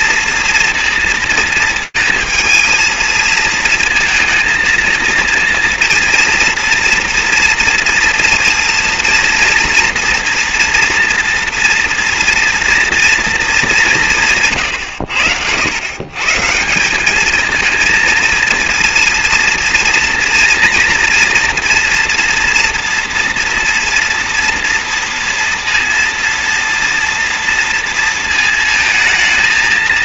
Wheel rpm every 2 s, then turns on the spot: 230, 220, 230, 230, 230, 240, 230, 100, 210, 230, 230, 230, 230, 230, 220.
none